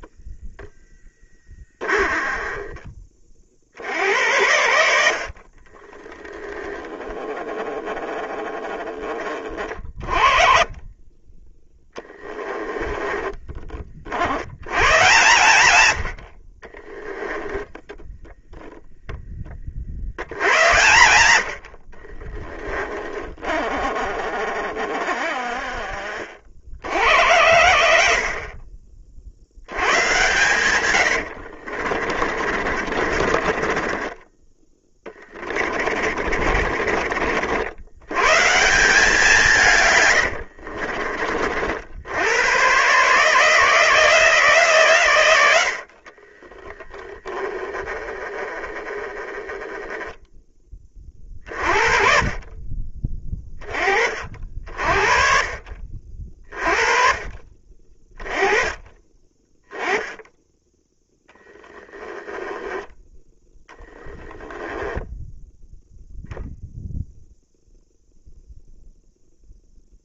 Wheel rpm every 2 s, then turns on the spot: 10, 30, 60, 10, 20, 20, 20, 120, 20, 10, 90, 30, 30, 60, 40, 80, 40, 20, 50, 170, 50, 150, 120, 10, 10, 30, 30, 40, 30, 20, 10, 10, 10, 0, 0.
0-2 12-14 16-18 22-26 30-38 40-42 46-48 64-66